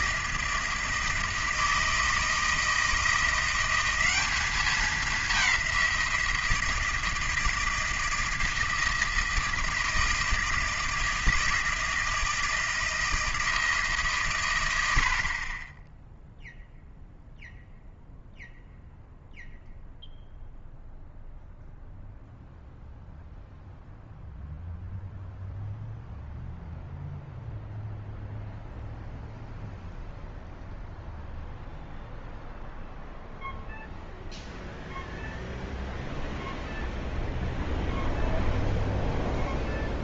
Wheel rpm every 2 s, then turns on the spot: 160, 160, 200, 160, 160, 160, 160, 120, 0, 0, 0, 0, 0, 0, 0, 0, 0, 0, 0, 0.
none